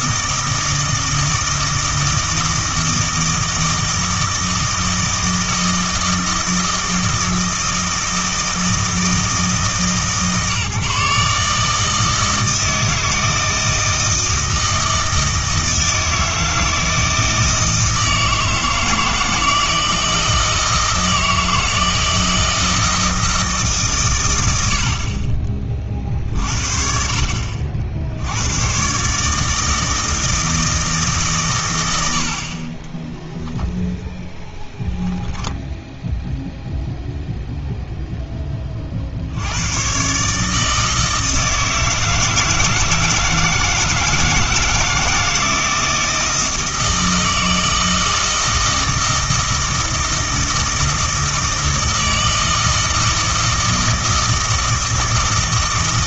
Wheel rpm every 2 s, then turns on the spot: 160, 160, 160, 160, 160, 150, 160, 160, 160, 160, 160, 160, 90, 50, 120, 160, 30, 10, 0, 30, 160, 160, 160, 160, 160, 160, 160, 160.
none